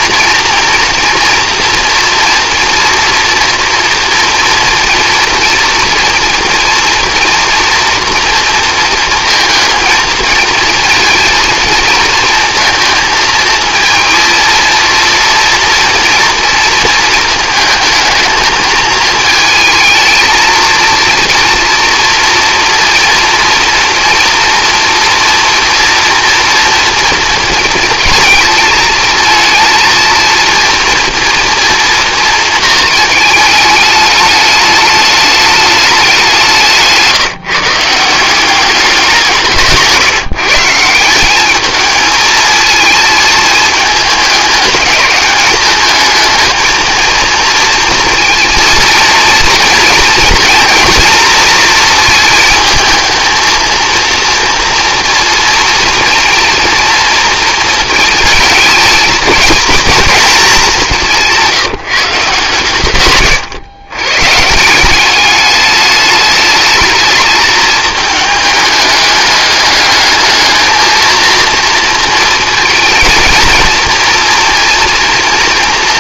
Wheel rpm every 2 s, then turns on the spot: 230, 240, 230, 230, 230, 230, 230, 230, 230, 220, 230, 230, 230, 230, 220, 230, 220, 210, 180, 190, 170, 220, 200, 230, 230, 230, 220, 230, 230, 220, 190, 130, 170, 220, 210, 220, 230, 230.
36-38